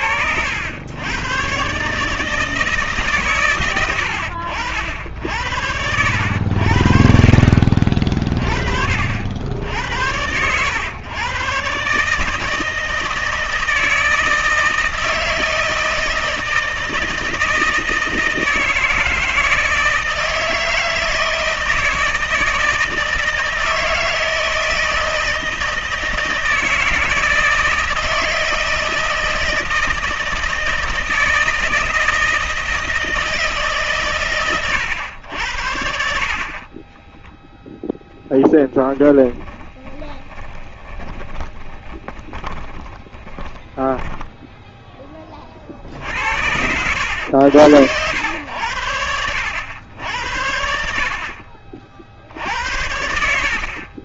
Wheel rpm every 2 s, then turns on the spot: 90, 150, 80, 70, 40, 100, 160, 160, 160, 160, 160, 160, 160, 160, 160, 160, 160, 110, 40, 10, 20, 20, 10, 70, 100, 70, 90.
36-44